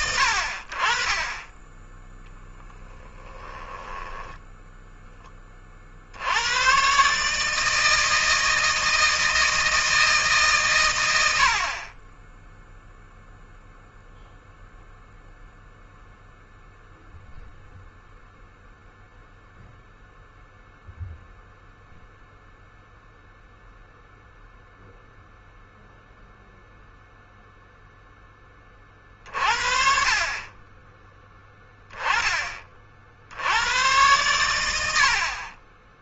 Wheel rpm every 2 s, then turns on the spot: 70, 10, 10, 110, 160, 130, 0, 0, 0, 0, 0, 0, 0, 0, 30, 30, 50, 80.
2-6